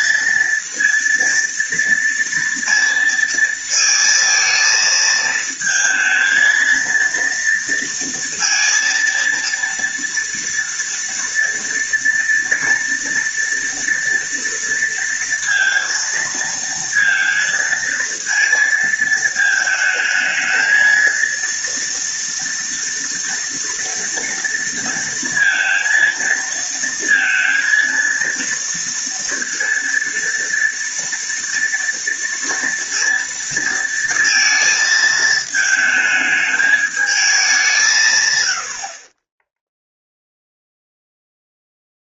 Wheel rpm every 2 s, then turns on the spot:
230, 230, 230, 230, 230, 230, 230, 230, 230, 220, 230, 230, 230, 230, 230, 230, 230, 220, 210, 50, 0.
none